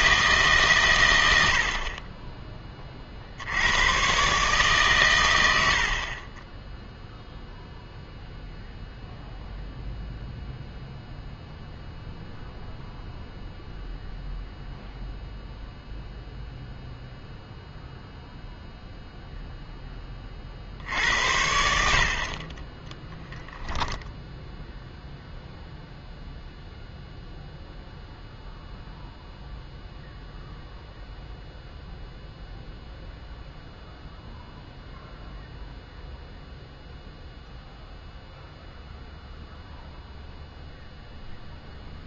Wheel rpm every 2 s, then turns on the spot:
130, 20, 140, 10, 0, 0, 0, 0, 0, 0, 60, 30, 0, 0, 0, 0, 0, 0, 0, 0, 0.
22-24